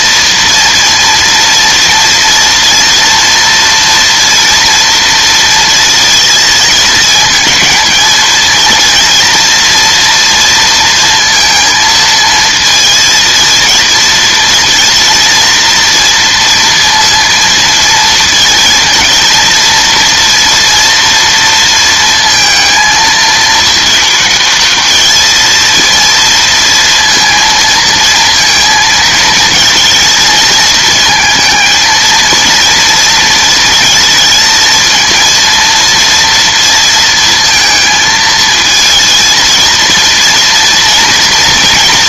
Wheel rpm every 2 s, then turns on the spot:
230, 230, 240, 220, 230, 230, 230, 230, 230, 230, 230, 220, 220, 230, 220, 220, 230, 230, 230, 230, 230.
none